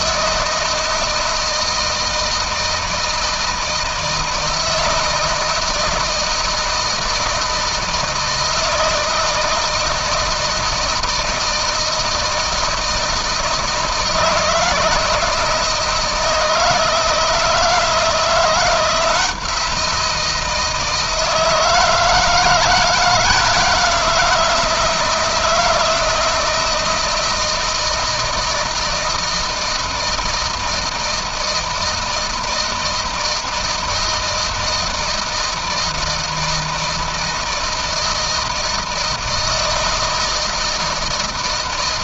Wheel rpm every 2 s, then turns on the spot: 160, 160, 160, 160, 160, 160, 160, 170, 160, 170, 160, 160, 160, 160, 160, 160, 160, 160, 160, 160, 160.
none